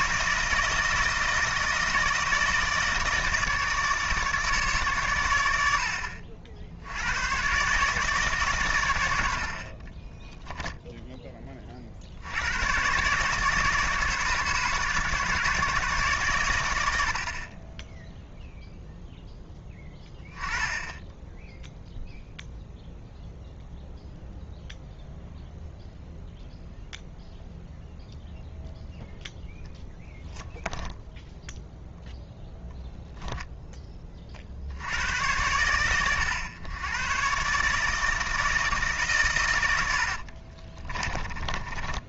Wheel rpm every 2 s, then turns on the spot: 160, 160, 150, 80, 130, 10, 110, 140, 100, 0, 10, 0, 0, 0, 0, 10, 0, 70, 110, 160, 40.
40-42